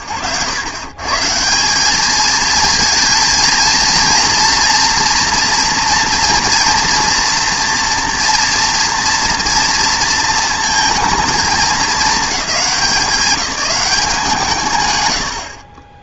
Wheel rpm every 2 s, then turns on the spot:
120, 220, 230, 230, 240, 230, 200, 130.
none